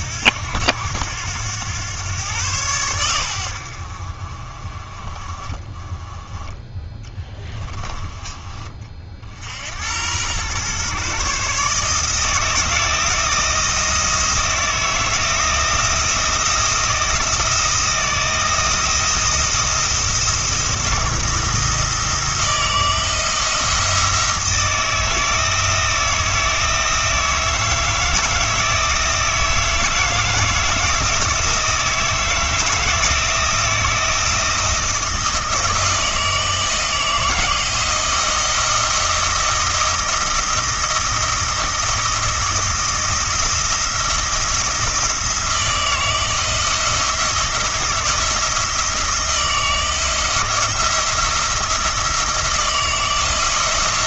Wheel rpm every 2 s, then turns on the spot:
90, 110, 30, 10, 40, 120, 160, 160, 170, 160, 160, 160, 160, 160, 160, 160, 160, 160, 160, 170, 170, 170, 170, 160, 170, 170, 170.
6-8